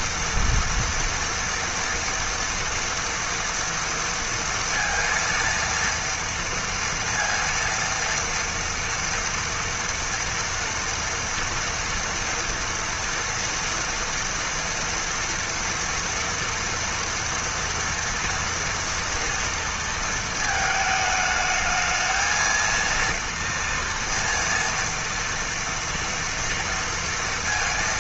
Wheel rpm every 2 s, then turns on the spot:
230, 230, 230, 230, 230, 230, 240, 230, 230, 230, 220, 230, 230, 230.
none